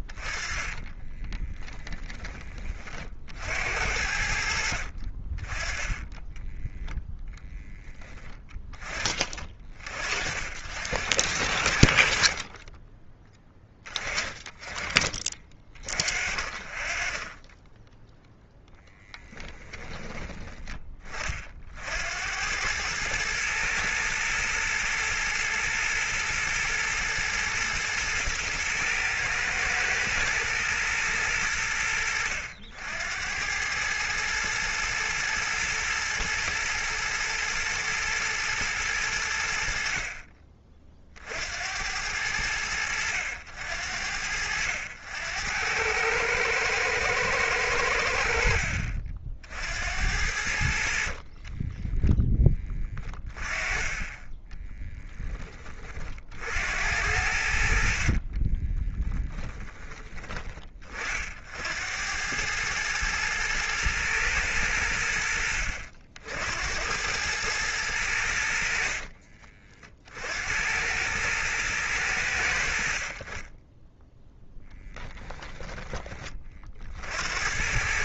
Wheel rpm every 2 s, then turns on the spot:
20, 60, 30, 10, 30, 70, 20, 40, 10, 20, 30, 110, 120, 110, 110, 90, 90, 110, 110, 80, 50, 80, 80, 110, 60, 40, 10, 10, 70, 20, 40, 110, 90, 90, 50, 90, 60, 10, 50.
0-2 18-20 50-52 58-60 68-70